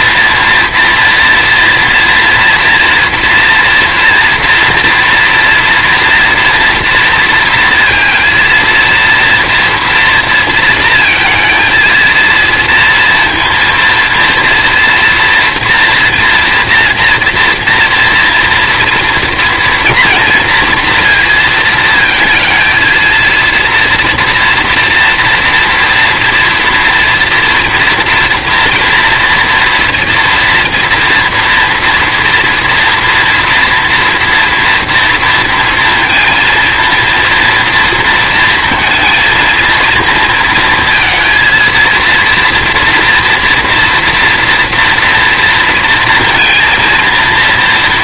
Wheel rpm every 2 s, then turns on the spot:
230, 230, 230, 230, 230, 230, 230, 230, 230, 230, 230, 230, 230, 230, 240, 240, 230, 230, 230, 230, 230, 230, 240, 230.
none